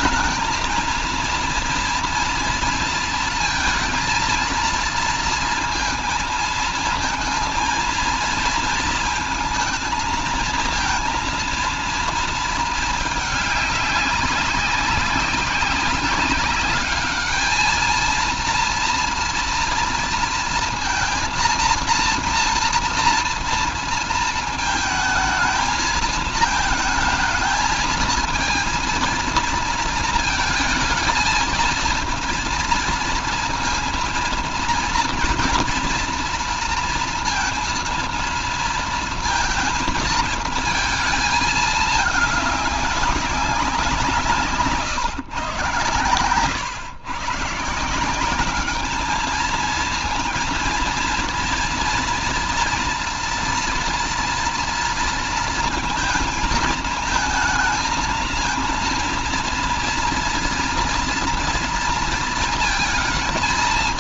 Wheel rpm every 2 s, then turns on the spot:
220, 230, 230, 230, 230, 230, 220, 190, 210, 230, 230, 230, 220, 220, 230, 230, 230, 230, 230, 230, 220, 200, 150, 110, 200, 230, 230, 230, 220, 230, 230, 220.
none